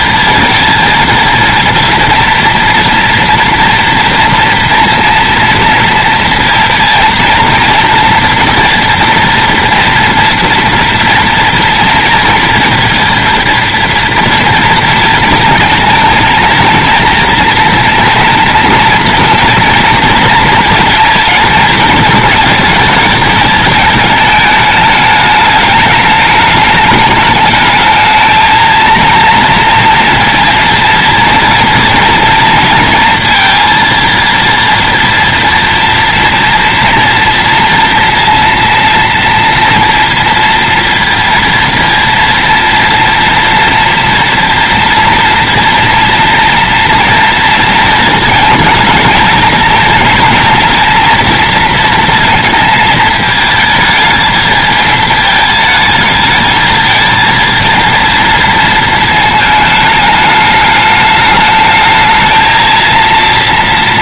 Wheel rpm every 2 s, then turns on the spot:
230, 230, 230, 230, 230, 230, 230, 230, 230, 240, 230, 220, 210, 210, 230, 230, 230, 230, 230, 230, 230, 230, 230, 230, 220, 230, 220, 220, 230, 220, 210, 230.
none